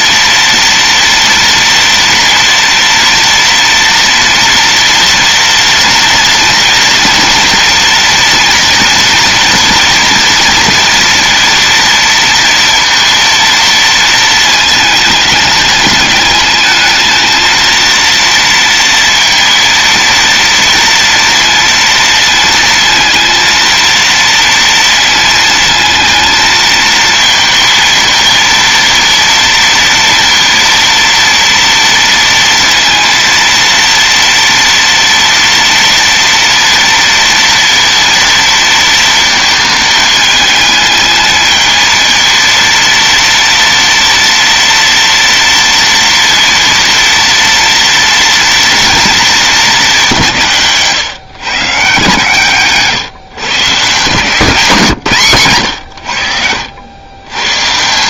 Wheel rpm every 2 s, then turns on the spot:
230, 230, 230, 230, 230, 230, 230, 220, 210, 230, 230, 230, 230, 220, 230, 230, 230, 230, 230, 230, 220, 230, 230, 230, 230, 180, 140, 170, 80.
none